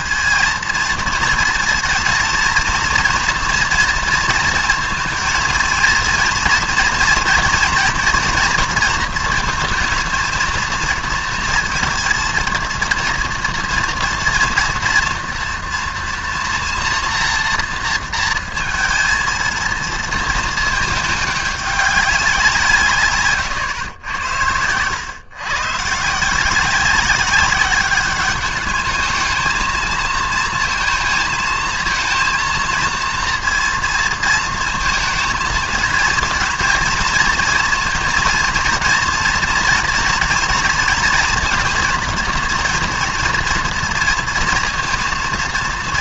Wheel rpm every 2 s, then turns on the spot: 230, 230, 230, 240, 230, 230, 230, 230, 240, 230, 220, 140, 120, 190, 210, 220, 230, 230, 230, 230, 230, 230, 230.
none